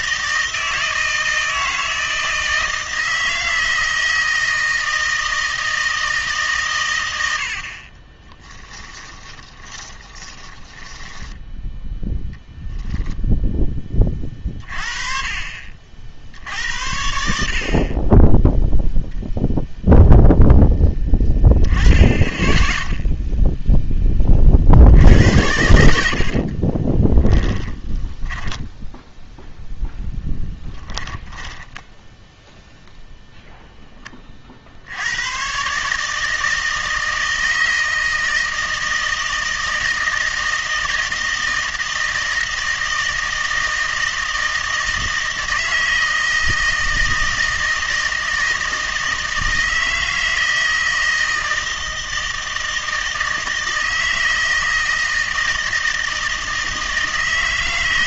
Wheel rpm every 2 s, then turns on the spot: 160, 160, 160, 130, 20, 20, 0, 40, 60, 0, 10, 10, 60, 30, 10, 10, 10, 60, 160, 160, 160, 160, 160, 160, 160, 160, 160, 160, 160.
8-12 26-32